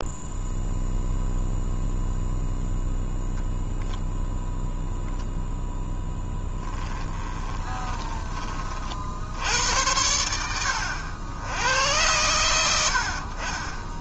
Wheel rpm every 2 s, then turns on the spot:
0, 0, 0, 10, 50, 80, 70.
6-8